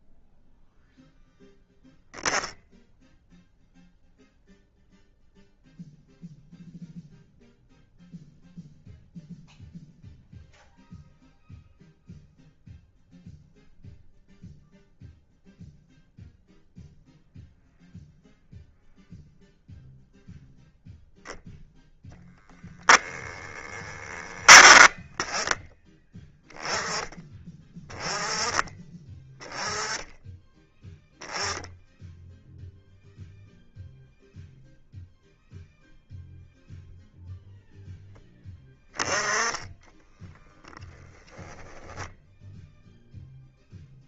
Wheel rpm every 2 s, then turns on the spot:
0, 0, 0, 0, 0, 0, 0, 0, 0, 0, 0, 0, 20, 10, 10, 10, 0, 0, 0, 20, 10, 0.
none